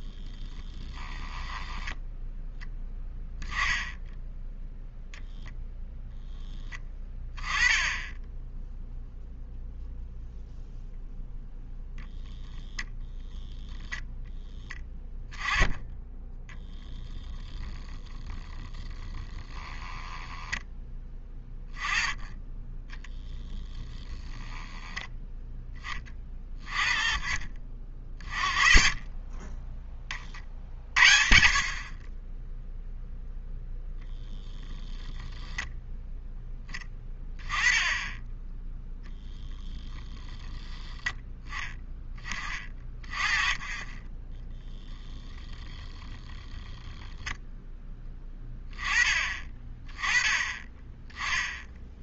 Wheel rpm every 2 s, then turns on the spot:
10, 10, 0, 10, 0, 0, 0, 10, 0, 0, 10, 10, 0, 30, 40, 50, 0, 10, 10, 0, 0, 20, 10, 10, 10, 20.
0-2 44-46